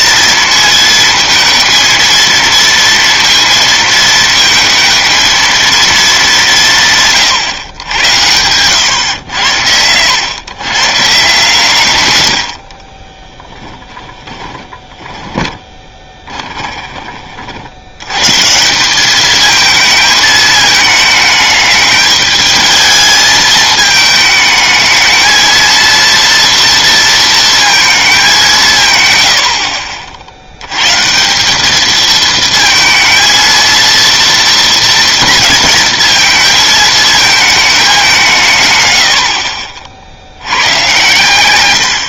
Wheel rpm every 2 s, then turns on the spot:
220, 230, 220, 160, 110, 130, 50, 20, 20, 180, 210, 220, 220, 230, 150, 120, 220, 230, 220, 120, 110.
14-18